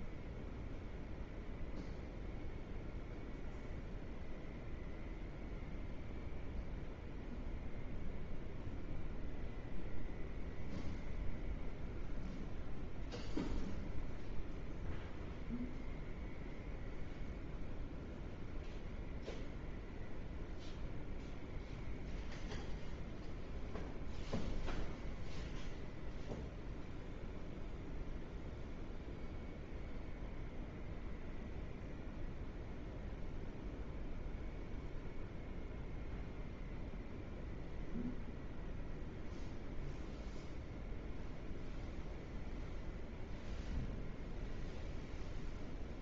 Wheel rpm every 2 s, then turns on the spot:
0, 0, 0, 0, 0, 0, 0, 0, 0, 0, 0, 0, 0, 0, 0, 0, 0, 0, 0, 0, 0, 0, 0.
none